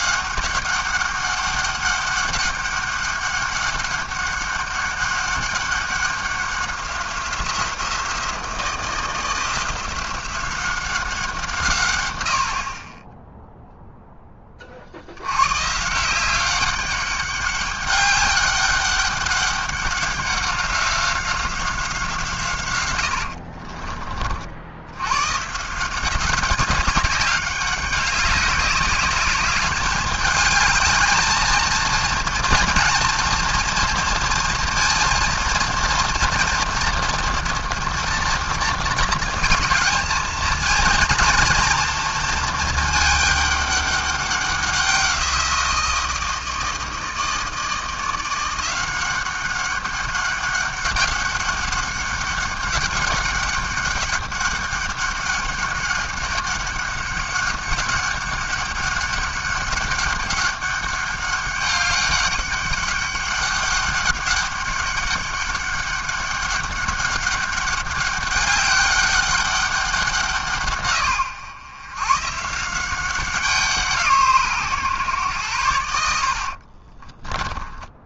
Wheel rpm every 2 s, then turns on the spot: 200, 200, 200, 180, 170, 170, 10, 100, 200, 200, 190, 70, 130, 200, 200, 220, 240, 230, 240, 220, 230, 210, 180, 160, 190, 200, 200, 200, 200, 200, 200, 200, 200, 200, 200, 120, 180, 120, 20.
22-24 76-78